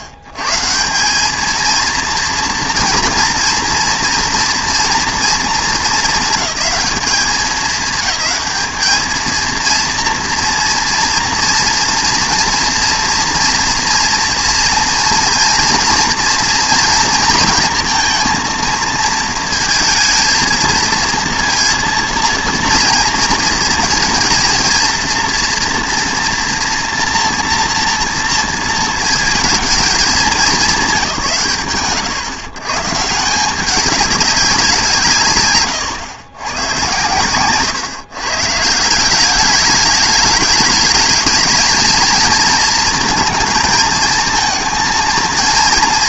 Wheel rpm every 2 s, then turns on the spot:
120, 240, 240, 200, 220, 230, 230, 230, 240, 230, 230, 230, 230, 230, 230, 200, 140, 180, 120, 150, 210, 230, 220.
none